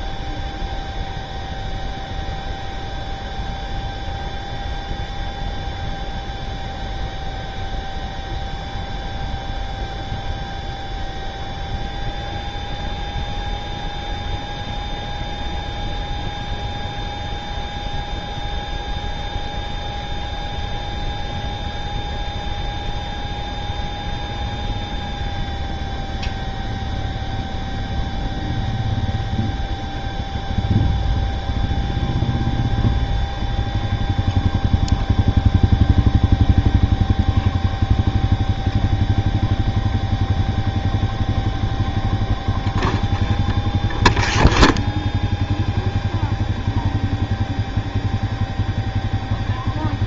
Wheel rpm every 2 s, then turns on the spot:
0, 0, 0, 0, 0, 0, 0, 0, 0, 0, 0, 0, 0, 0, 0, 0, 0, 0, 0, 0, 0, 0, 0, 0, 0.
none